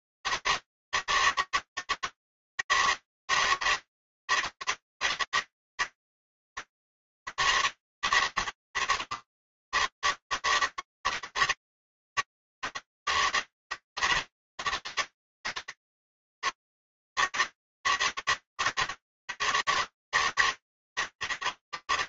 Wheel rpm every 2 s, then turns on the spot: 160, 160, 160, 160, 150, 150, 160, 140, 140, 150, 150.
none